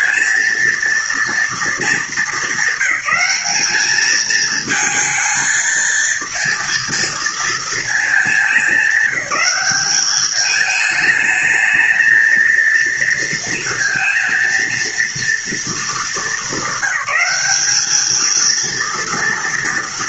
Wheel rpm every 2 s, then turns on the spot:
230, 210, 220, 230, 220, 210, 230, 230, 210, 220.
none